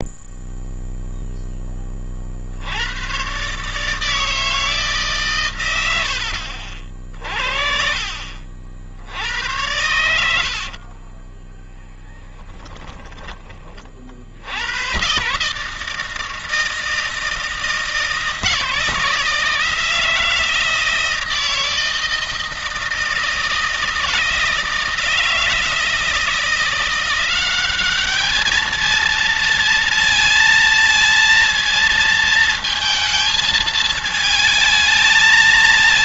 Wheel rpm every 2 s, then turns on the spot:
0, 90, 150, 50, 70, 50, 10, 110, 160, 160, 170, 160, 160, 180, 220, 230, 220, 220.
6-8 10-14